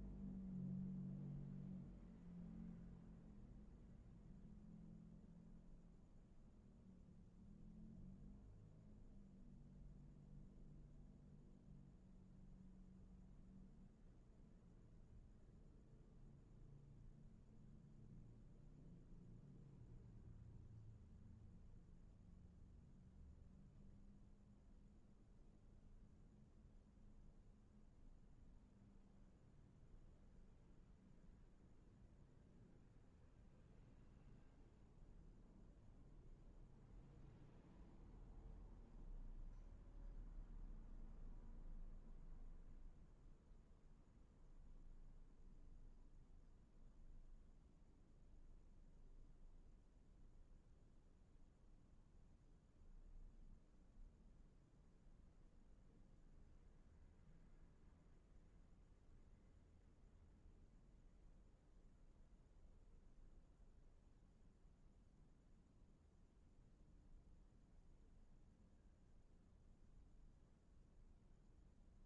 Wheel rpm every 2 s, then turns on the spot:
0, 0, 0, 0, 0, 0, 0, 0, 0, 0, 0, 0, 0, 0, 0, 0, 0, 0, 0, 0, 0, 0, 0, 0, 0, 0, 0, 0, 0, 0, 0, 0, 0, 0, 0, 0.
none